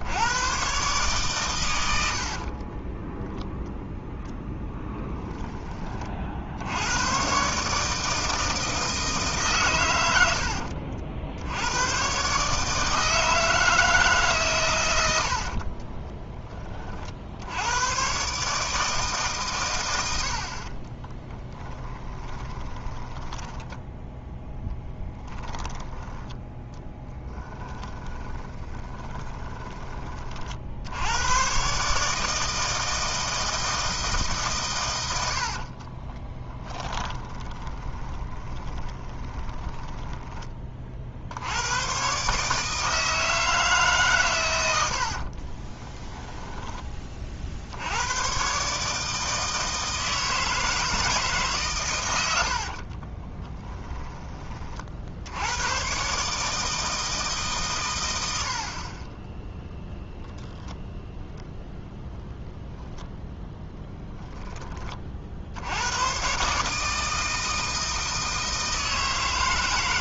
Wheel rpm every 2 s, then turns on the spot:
120, 20, 10, 100, 160, 70, 160, 100, 30, 150, 40, 20, 10, 10, 20, 70, 160, 110, 10, 20, 30, 150, 80, 20, 150, 160, 50, 50, 160, 30, 0, 20, 20, 150, 160.
2-6 10-12 20-24 28-30 36-40 44-46 52-54 62-64